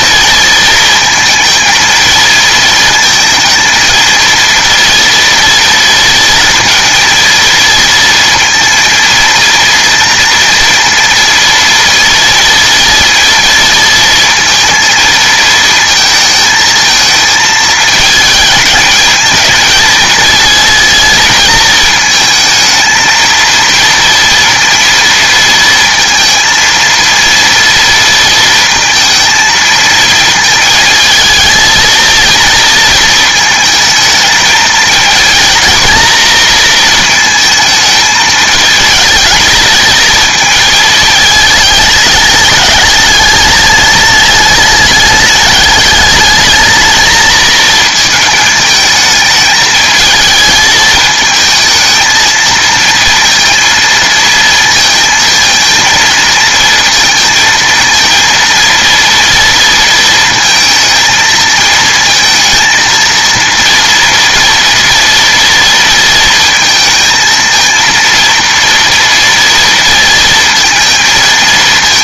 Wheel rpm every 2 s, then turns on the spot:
230, 220, 230, 230, 230, 230, 230, 230, 220, 220, 230, 220, 230, 230, 230, 220, 230, 220, 230, 220, 220, 210, 210, 220, 220, 220, 230, 220, 220, 230, 230, 220, 230, 220, 240, 220.
none